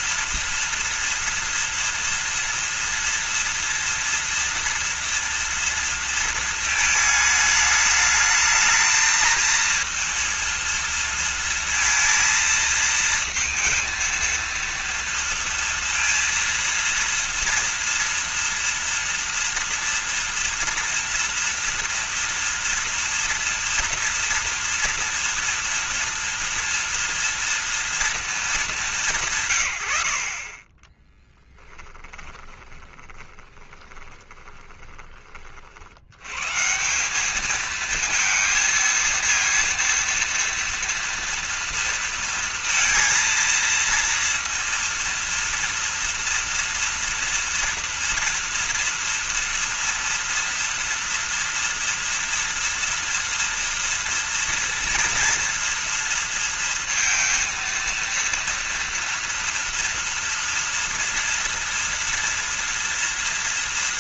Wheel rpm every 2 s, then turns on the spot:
230, 230, 230, 220, 220, 230, 230, 230, 230, 230, 230, 230, 230, 230, 210, 30, 20, 20, 170, 230, 230, 230, 230, 230, 230, 230, 230, 230, 230, 230, 240, 230.
30-34